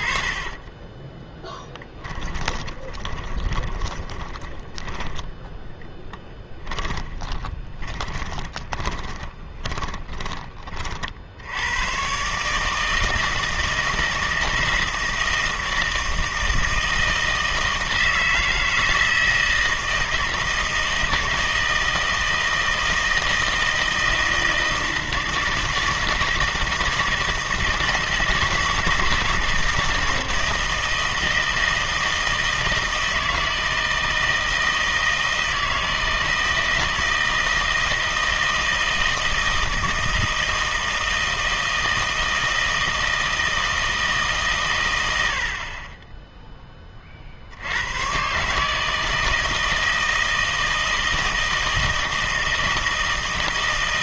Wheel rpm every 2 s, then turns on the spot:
10, 10, 10, 20, 20, 30, 150, 160, 160, 160, 160, 160, 160, 160, 160, 160, 160, 160, 160, 160, 160, 160, 130, 10, 150, 160, 160.
0-10